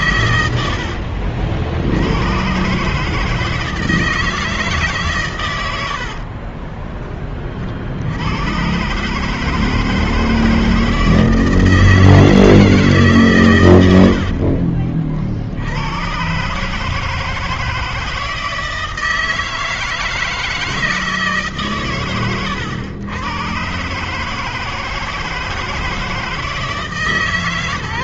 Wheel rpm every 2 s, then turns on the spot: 90, 120, 160, 30, 100, 160, 160, 60, 130, 160, 160, 110, 160, 160.
6-8 14-16